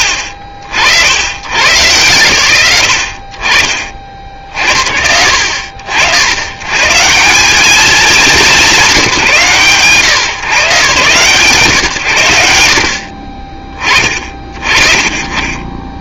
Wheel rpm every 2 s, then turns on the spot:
70, 60, 60, 160, 170, 130, 80, 40.
none